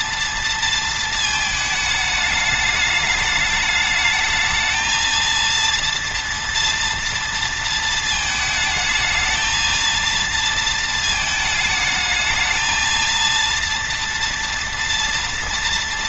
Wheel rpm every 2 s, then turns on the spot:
230, 210, 220, 230, 220, 220, 220, 230.
none